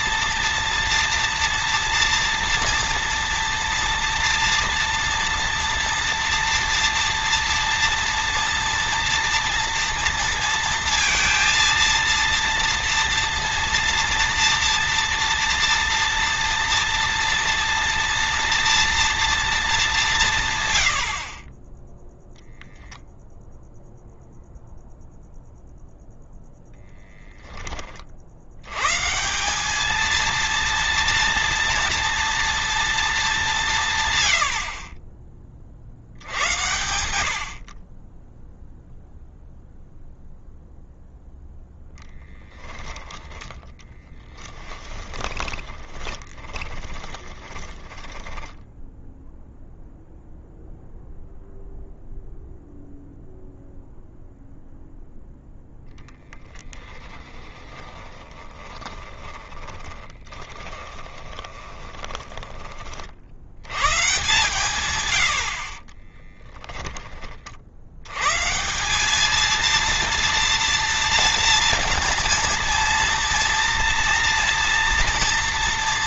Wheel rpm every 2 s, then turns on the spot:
230, 230, 230, 230, 240, 230, 230, 230, 230, 230, 90, 0, 0, 0, 120, 230, 230, 40, 100, 0, 0, 10, 20, 20, 0, 0, 0, 0, 20, 10, 20, 40, 120, 30, 180, 230, 230, 230.
44-48 56-62